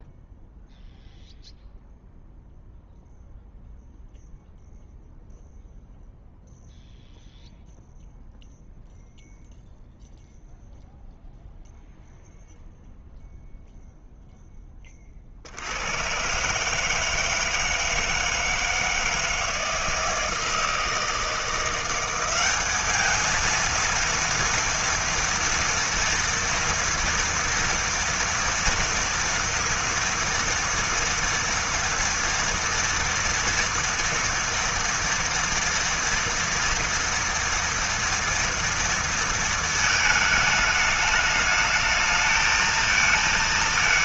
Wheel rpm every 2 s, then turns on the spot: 0, 0, 0, 0, 0, 0, 0, 40, 160, 160, 160, 220, 230, 230, 230, 230, 230, 230, 230, 230, 210, 230.
none